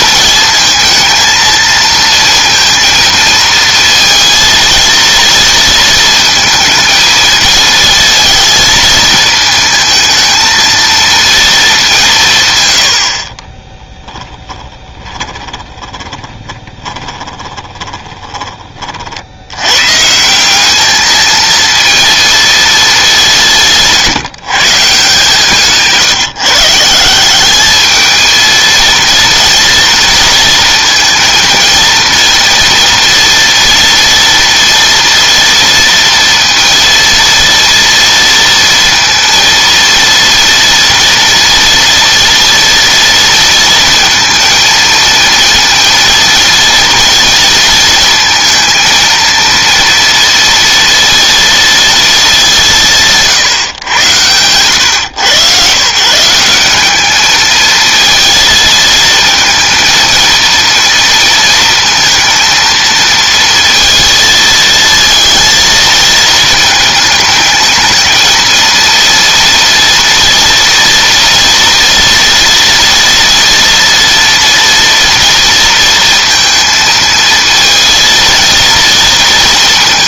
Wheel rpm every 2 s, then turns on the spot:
230, 230, 230, 230, 220, 230, 90, 10, 20, 30, 200, 220, 150, 160, 230, 230, 240, 230, 230, 230, 230, 230, 230, 230, 230, 230, 180, 110, 200, 220, 230, 230, 220, 220, 230, 230, 230, 230, 230, 230.
14-18